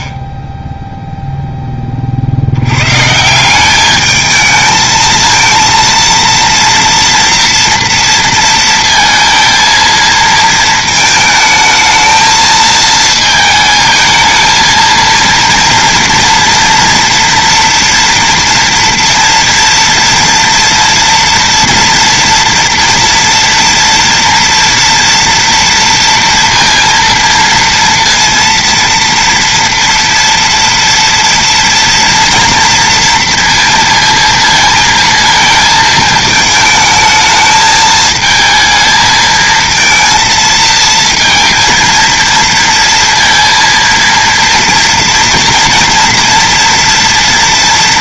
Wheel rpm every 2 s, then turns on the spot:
0, 90, 220, 230, 230, 220, 220, 220, 230, 230, 230, 230, 240, 230, 230, 230, 240, 230, 220, 220, 230, 230, 230, 240.
none